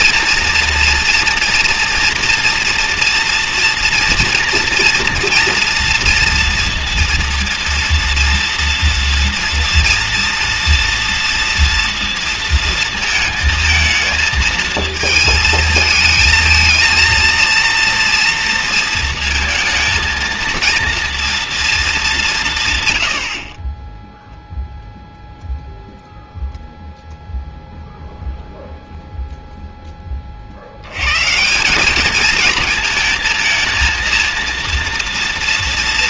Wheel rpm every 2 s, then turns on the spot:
230, 230, 230, 230, 230, 230, 220, 220, 230, 230, 230, 100, 0, 0, 0, 110, 220, 230.
none